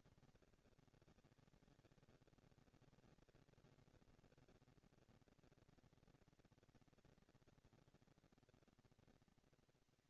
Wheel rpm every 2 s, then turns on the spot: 200, 200, 230, 230, 230.
none